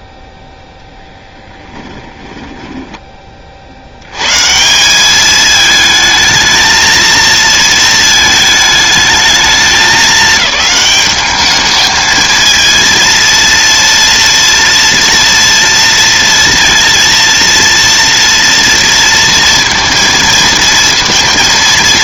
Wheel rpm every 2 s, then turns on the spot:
0, 10, 150, 220, 220, 210, 220, 230, 230, 230, 230.
2-4